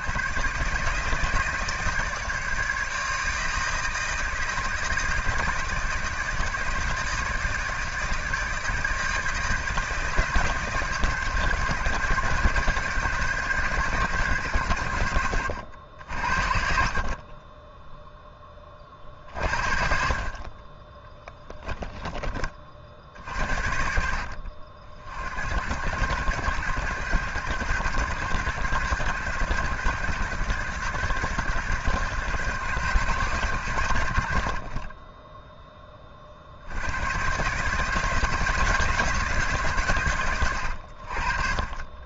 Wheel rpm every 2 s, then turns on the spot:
150, 150, 160, 150, 150, 150, 140, 110, 40, 30, 20, 50, 60, 110, 110, 120, 120, 30, 70, 160, 80.
none